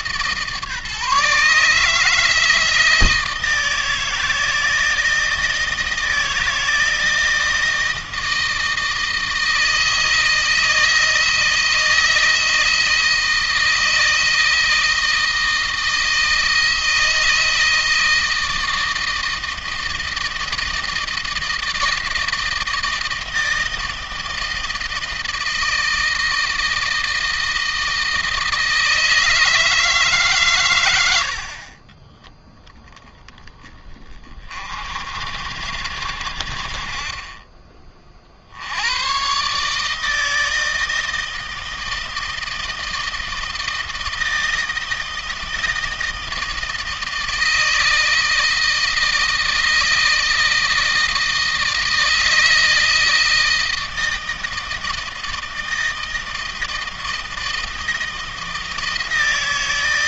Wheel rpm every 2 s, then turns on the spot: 150, 160, 160, 160, 160, 160, 160, 160, 160, 160, 160, 160, 160, 160, 160, 110, 10, 70, 40, 110, 160, 160, 160, 160, 160, 160, 160, 160, 160, 160.
none